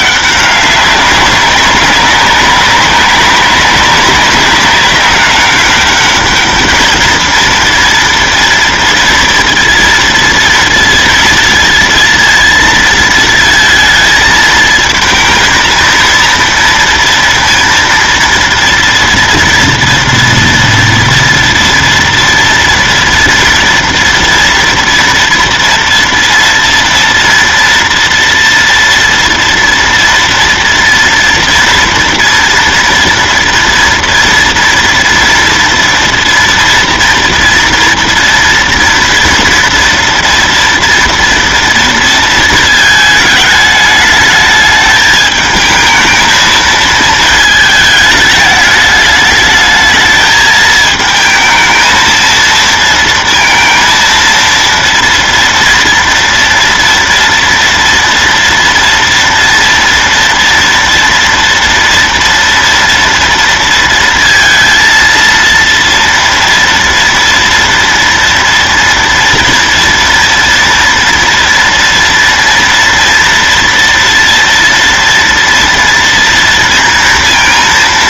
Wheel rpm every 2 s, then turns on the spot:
200, 200, 200, 210, 230, 230, 230, 220, 230, 230, 230, 240, 230, 230, 240, 230, 240, 230, 230, 230, 230, 230, 210, 220, 210, 220, 220, 230, 230, 240, 240, 230, 230, 230, 230, 230, 230, 230, 230.
none